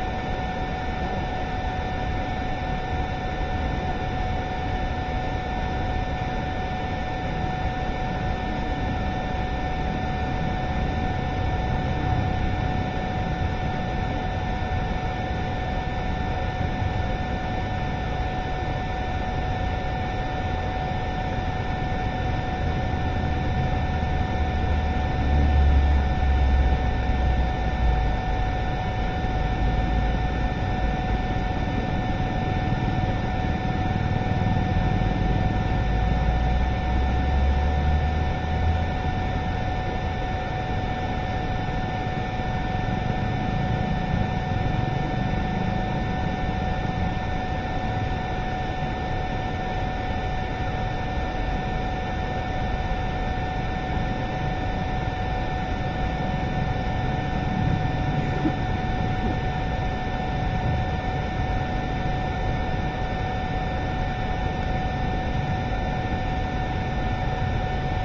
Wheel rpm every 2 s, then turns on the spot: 0, 0, 0, 0, 0, 0, 0, 0, 0, 0, 0, 0, 0, 0, 0, 0, 0, 0, 0, 0, 0, 0, 0, 0, 0, 0, 0, 0, 0, 0, 0, 0, 0, 0.
none